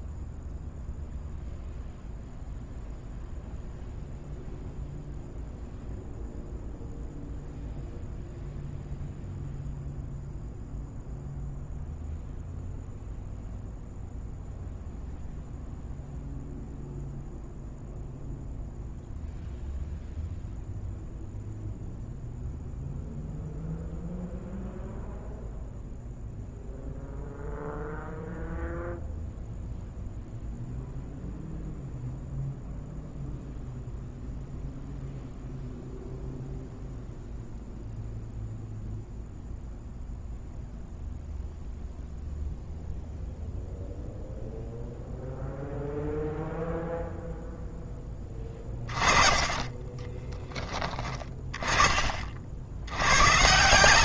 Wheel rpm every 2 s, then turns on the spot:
0, 0, 0, 0, 0, 0, 0, 0, 0, 0, 0, 0, 0, 0, 0, 0, 0, 0, 0, 0, 0, 0, 0, 0, 20, 20, 90.
48-50